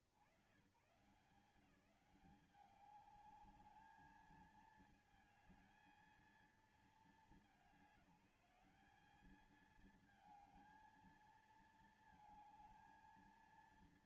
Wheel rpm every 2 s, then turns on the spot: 80, 190, 220, 220, 190, 220, 220.
none